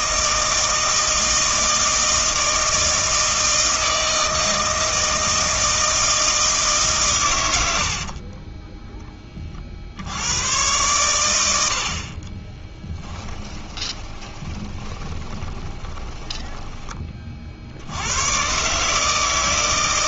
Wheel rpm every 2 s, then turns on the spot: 160, 160, 160, 150, 10, 110, 10, 20, 20, 130.
8-10 12-18